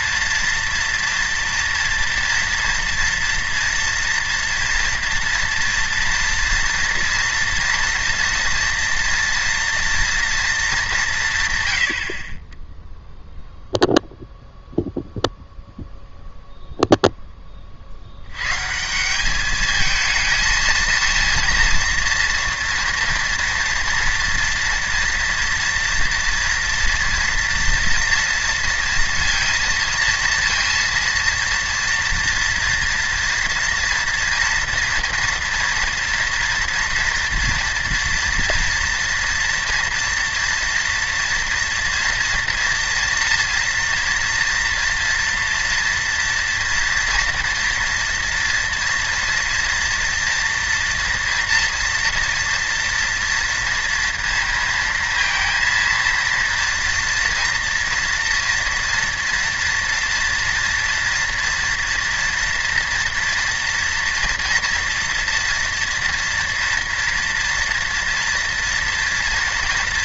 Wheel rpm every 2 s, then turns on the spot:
230, 230, 230, 230, 230, 220, 20, 0, 0, 130, 230, 230, 230, 230, 230, 230, 230, 230, 230, 230, 230, 230, 230, 230, 230, 230, 230, 230, 230, 240, 230, 230, 230, 230, 240.
none